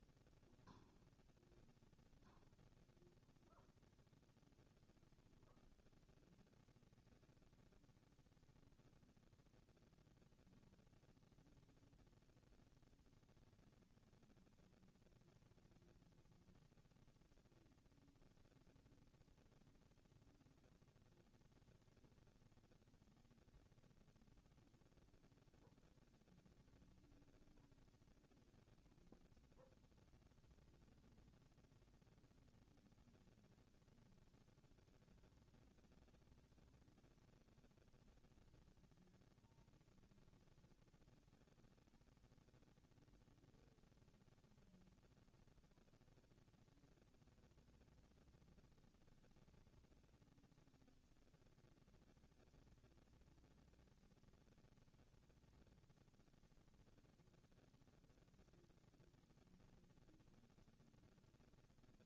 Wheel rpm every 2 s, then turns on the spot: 0, 0, 0, 0, 0, 0, 0, 0, 0, 0, 0, 0, 0, 0, 0, 0, 0, 0, 0, 0, 0, 0, 0, 0, 0, 0, 0, 0, 0, 0, 0.
none